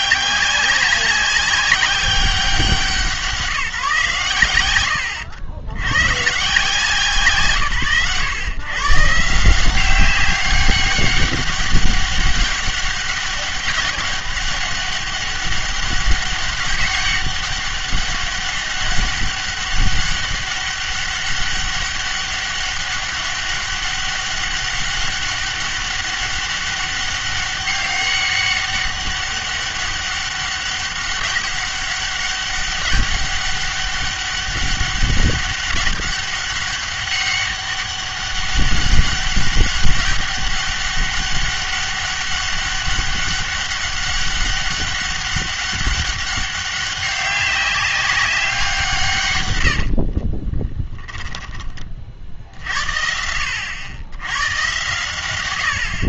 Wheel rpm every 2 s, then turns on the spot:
190, 180, 100, 150, 120, 200, 200, 200, 200, 200, 200, 200, 200, 200, 200, 200, 200, 200, 200, 200, 190, 200, 200, 200, 180, 20, 70, 110.
50-52